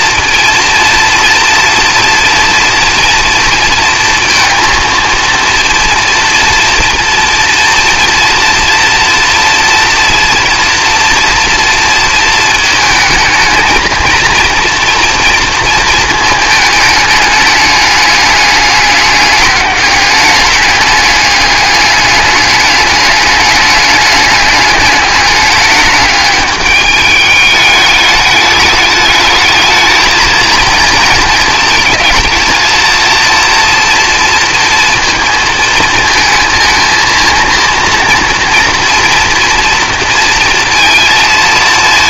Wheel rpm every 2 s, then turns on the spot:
230, 230, 230, 230, 230, 230, 230, 230, 220, 210, 210, 210, 210, 210, 210, 220, 230, 230, 230, 230, 230.
none